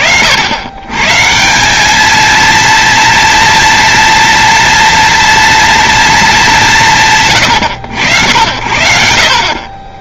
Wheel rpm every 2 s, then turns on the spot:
140, 230, 230, 110, 60.
none